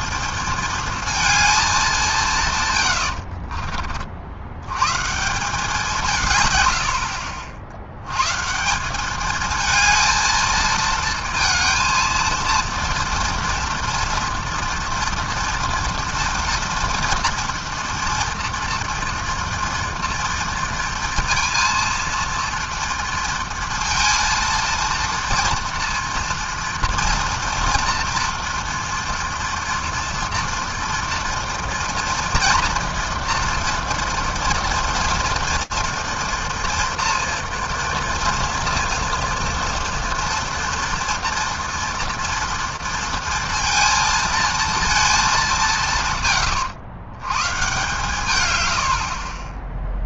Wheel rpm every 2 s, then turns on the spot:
230, 140, 90, 100, 160, 220, 230, 230, 230, 230, 230, 230, 230, 230, 230, 230, 230, 230, 230, 230, 230, 230, 230, 110, 100.
none